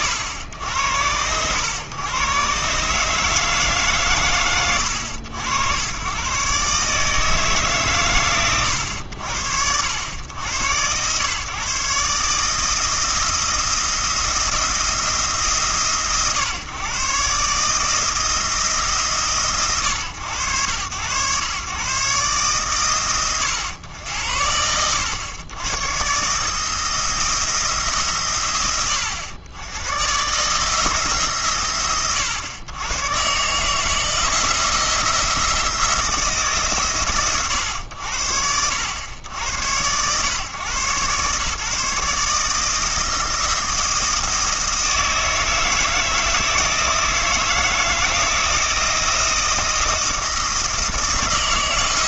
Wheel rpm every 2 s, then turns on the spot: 90, 140, 90, 150, 90, 110, 160, 160, 130, 160, 100, 120, 80, 160, 90, 150, 110, 170, 140, 100, 120, 160, 160, 160, 160, 160.
none